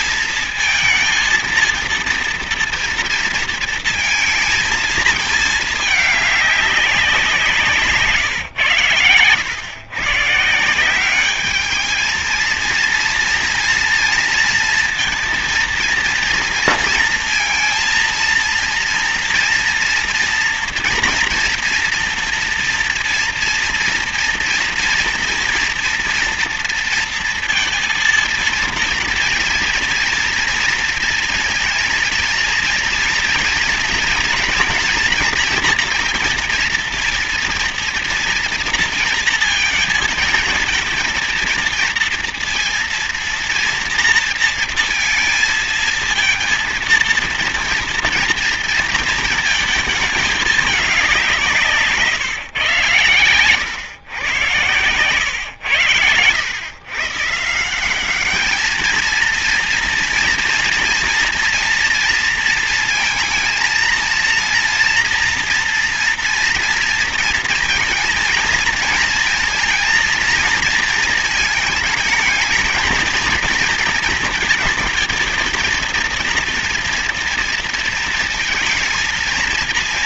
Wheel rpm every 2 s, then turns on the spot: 230, 230, 230, 210, 130, 160, 230, 230, 230, 230, 230, 230, 230, 230, 230, 230, 230, 240, 230, 230, 220, 230, 230, 230, 230, 210, 140, 120, 110, 200, 230, 230, 230, 230, 230, 230, 220, 230, 240, 230.
none